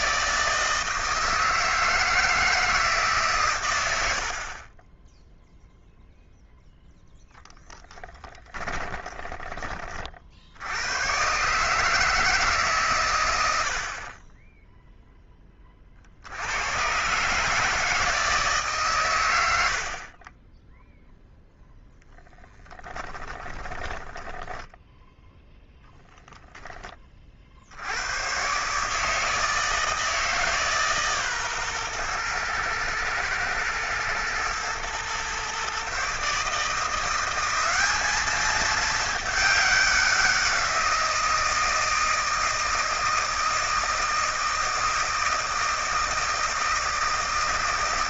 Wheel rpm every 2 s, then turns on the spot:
160, 160, 60, 0, 10, 60, 150, 20, 80, 150, 20, 10, 10, 10, 120, 150, 120, 120, 150, 210, 180, 160, 160, 160.
4-6 8-10 20-22